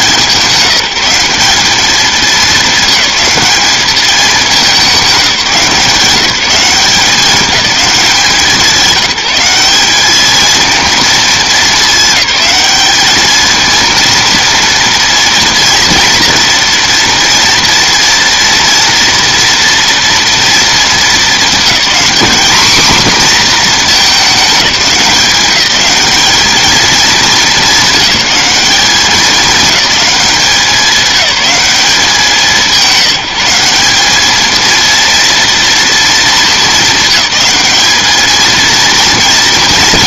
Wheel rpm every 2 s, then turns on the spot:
180, 200, 210, 190, 190, 230, 210, 230, 230, 230, 230, 240, 200, 220, 210, 200, 190, 220, 220, 220.
none